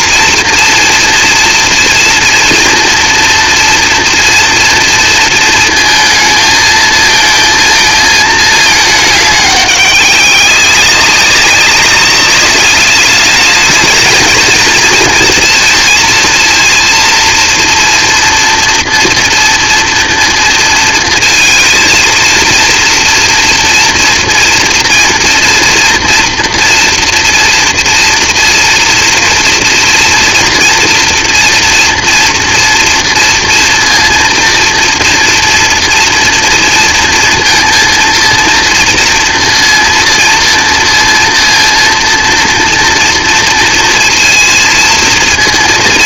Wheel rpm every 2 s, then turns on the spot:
230, 230, 230, 220, 210, 190, 200, 220, 230, 230, 230, 230, 230, 230, 230, 240, 230, 230, 230, 230, 230, 230, 230.
none